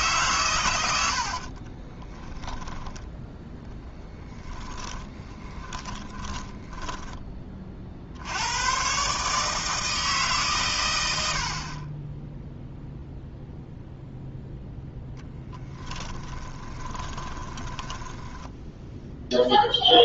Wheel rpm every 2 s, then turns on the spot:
110, 20, 20, 10, 130, 110, 0, 0, 20, 0.
0-8 16-18